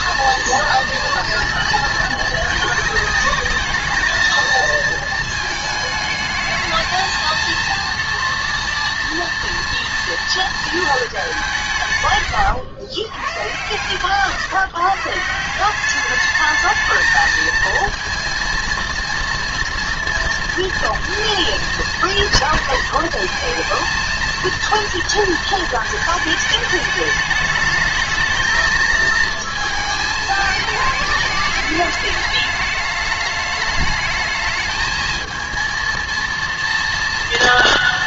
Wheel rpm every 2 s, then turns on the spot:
240, 220, 230, 220, 230, 220, 120, 150, 220, 230, 230, 230, 230, 210, 220, 220, 210, 210, 230.
none